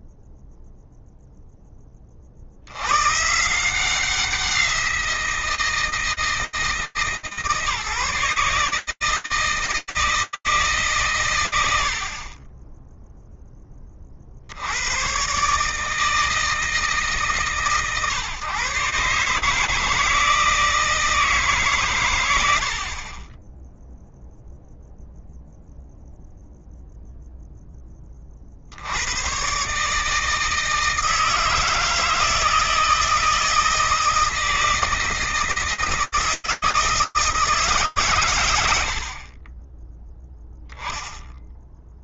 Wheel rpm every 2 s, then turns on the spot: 0, 110, 170, 160, 160, 150, 30, 80, 150, 140, 160, 50, 0, 0, 130, 160, 160, 160, 160, 40, 0.
38-40